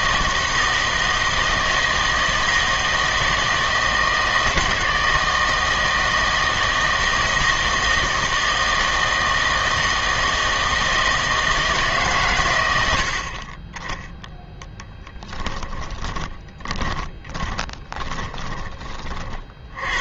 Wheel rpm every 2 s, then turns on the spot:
160, 160, 160, 160, 160, 160, 100, 10, 20, 20.
16-18